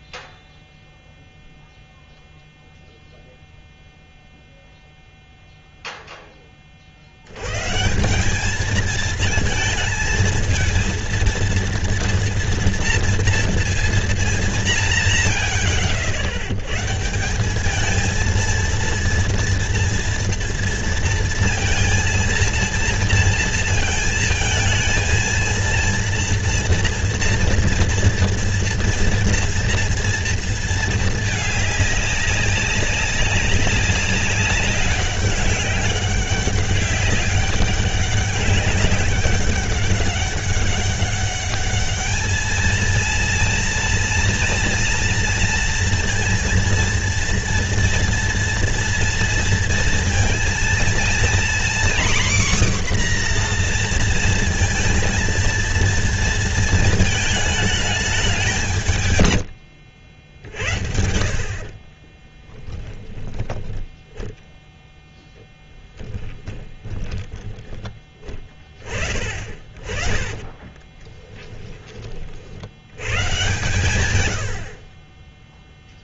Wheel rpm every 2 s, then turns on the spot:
0, 0, 0, 40, 220, 220, 230, 190, 120, 230, 230, 230, 220, 230, 230, 230, 200, 200, 190, 200, 200, 220, 230, 230, 230, 230, 260, 230, 220, 190, 80, 10, 10, 10, 30, 20, 80, 60.
66-68 70-72